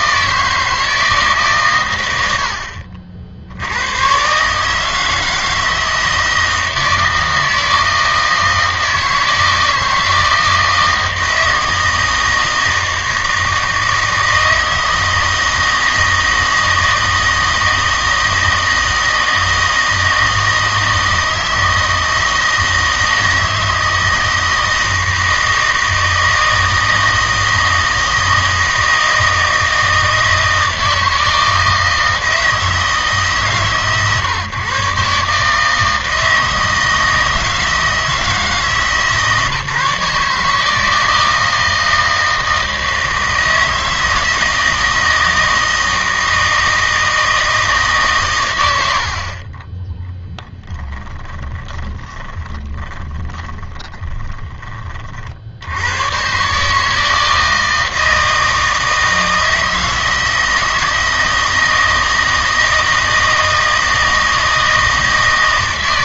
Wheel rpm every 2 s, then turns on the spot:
160, 60, 150, 160, 160, 160, 160, 160, 160, 160, 160, 160, 160, 160, 160, 160, 160, 140, 160, 160, 160, 160, 160, 160, 90, 10, 30, 20, 150, 160, 160, 160, 160.
48-54